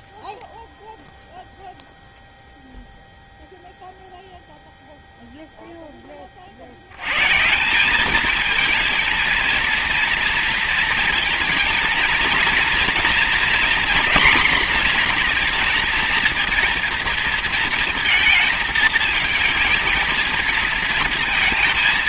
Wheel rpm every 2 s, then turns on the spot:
0, 0, 0, 100, 220, 230, 230, 230, 230, 220, 220.
none